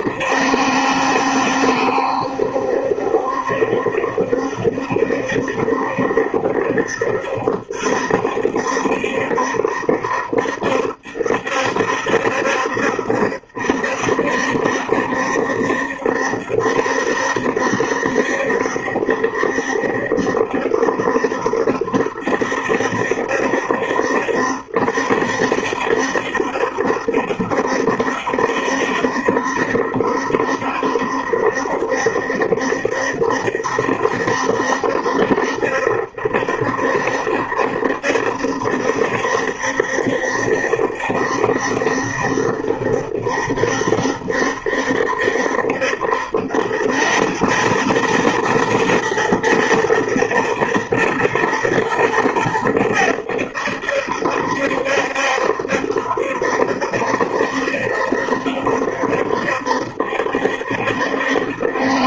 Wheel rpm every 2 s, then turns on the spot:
70, 70, 70, 70, 70, 70, 70, 70, 70, 70, 70, 70, 70, 70, 70, 70, 70, 70, 70, 70, 70, 70, 70, 90, 110, 120, 90, 70, 70, 70, 70.
none